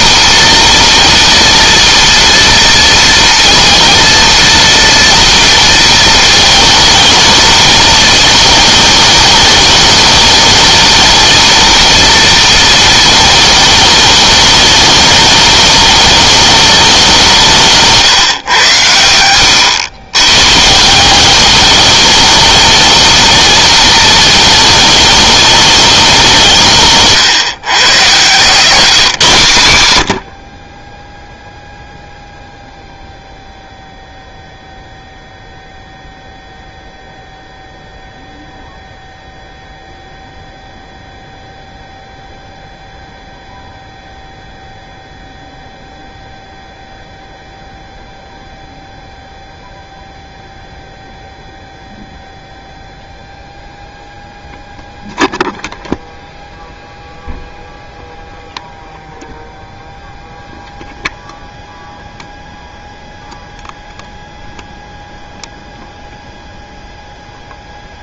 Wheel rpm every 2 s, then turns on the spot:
240, 230, 230, 220, 210, 220, 220, 210, 170, 90, 180, 220, 210, 140, 160, 0, 0, 0, 0, 0, 0, 0, 0, 0, 0, 0, 0, 0, 0, 0, 0, 0, 0, 0.
none